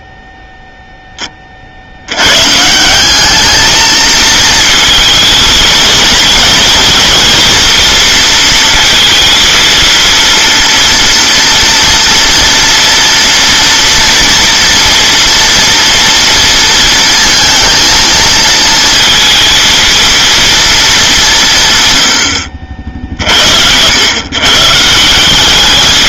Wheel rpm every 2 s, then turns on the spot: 0, 170, 230, 220, 230, 230, 230, 230, 230, 230, 220, 50, 160.
none